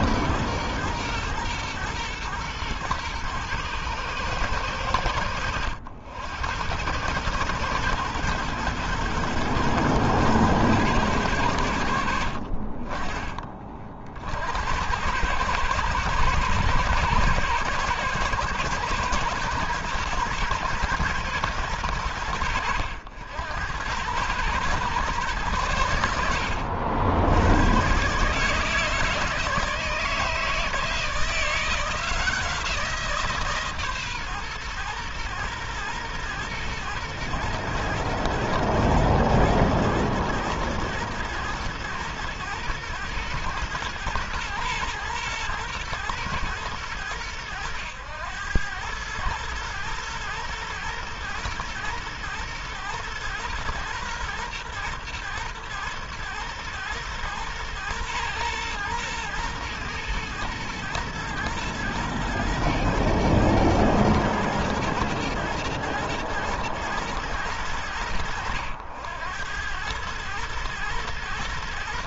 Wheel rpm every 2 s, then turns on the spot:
120, 110, 80, 100, 110, 110, 30, 90, 110, 110, 120, 80, 110, 80, 160, 160, 160, 120, 110, 120, 110, 110, 110, 110, 110, 120, 120, 120, 120, 120, 110, 120, 110, 110, 90, 110.
none